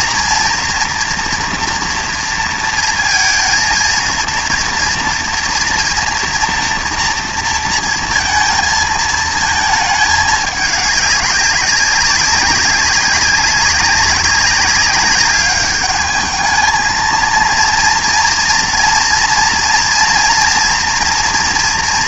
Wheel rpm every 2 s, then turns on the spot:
230, 230, 230, 230, 230, 210, 190, 200, 220, 230, 230.
none